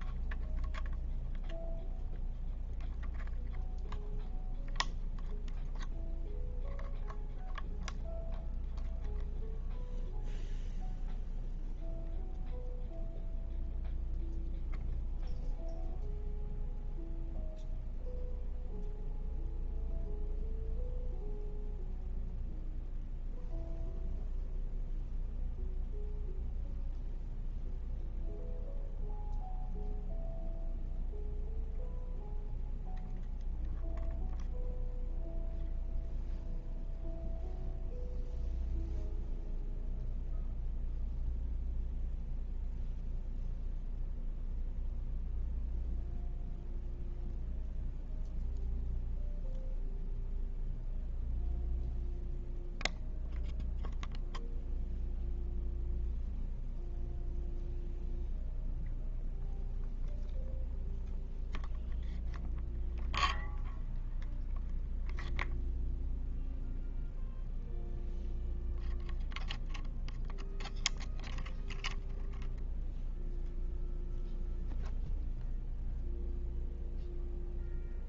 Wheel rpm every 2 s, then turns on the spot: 0, 0, 0, 0, 0, 0, 0, 0, 0, 0, 0, 0, 0, 0, 0, 0, 0, 0, 0, 0, 0, 0, 0, 0, 0, 0, 0, 0, 0, 0, 0, 0, 0, 0, 0, 0, 0, 0, 0.
none